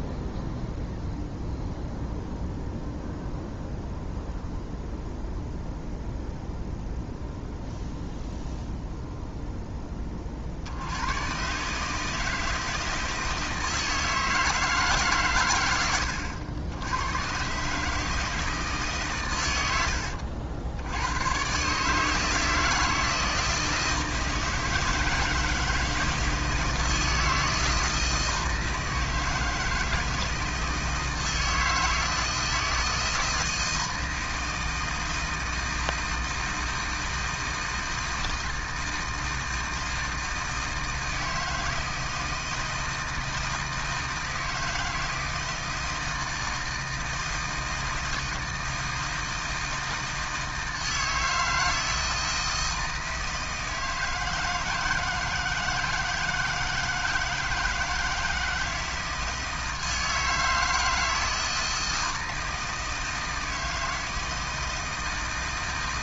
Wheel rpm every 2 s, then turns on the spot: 0, 0, 0, 0, 0, 90, 160, 140, 90, 140, 100, 160, 160, 160, 160, 160, 160, 160, 160, 160, 160, 160, 160, 160, 160, 160, 160, 160, 160, 160, 160, 160, 160.
none